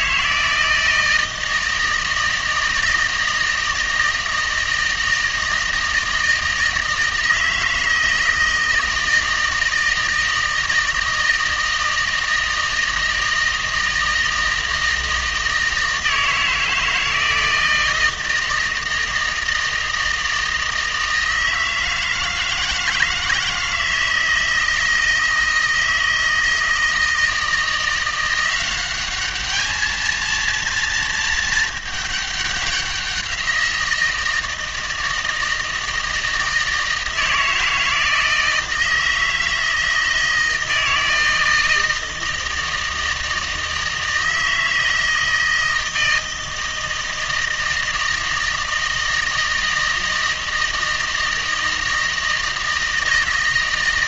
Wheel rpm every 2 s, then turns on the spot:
160, 160, 160, 160, 160, 160, 160, 160, 160, 160, 160, 160, 160, 160, 180, 230, 190, 160, 160, 160, 160, 160, 160, 160, 160, 160, 160.
none